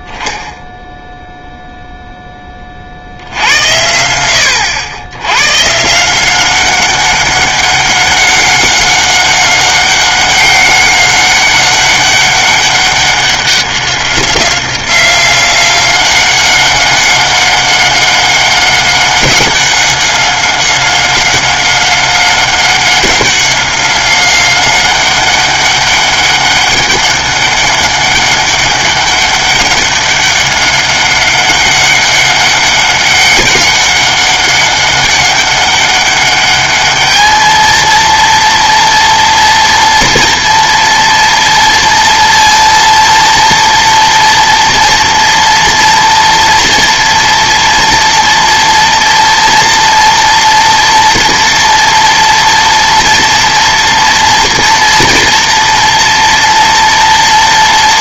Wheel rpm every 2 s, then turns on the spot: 0, 30, 90, 190, 190, 190, 200, 190, 190, 190, 190, 190, 190, 200, 200, 200, 200, 200, 210, 230, 230, 230, 230, 230, 230, 230, 230, 230, 230.
none